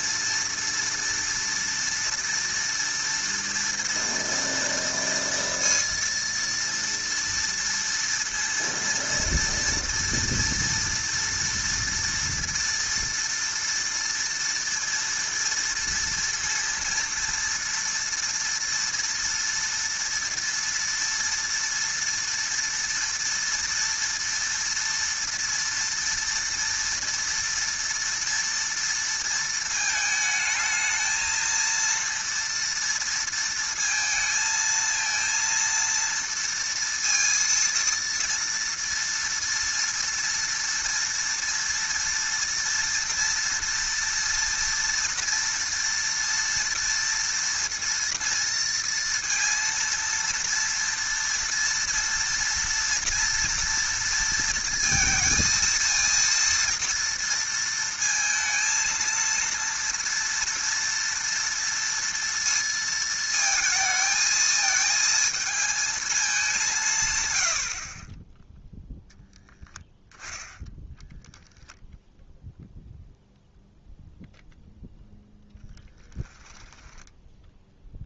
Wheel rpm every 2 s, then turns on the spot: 230, 230, 230, 230, 230, 240, 230, 230, 230, 230, 230, 230, 240, 230, 230, 220, 230, 230, 230, 230, 230, 230, 230, 230, 230, 230, 230, 230, 230, 220, 230, 230, 220, 200, 10, 10, 0, 0, 10.
76-78